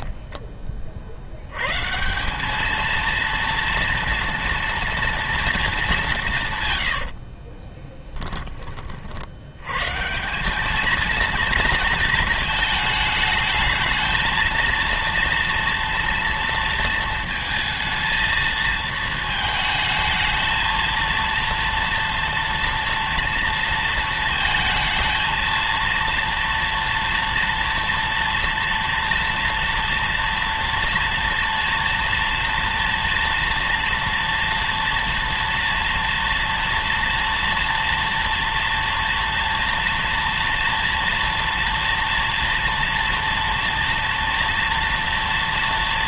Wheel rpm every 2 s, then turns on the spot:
30, 220, 230, 120, 30, 210, 220, 230, 230, 220, 220, 230, 230, 230, 230, 230, 230, 230, 230, 230, 230, 230, 230.
none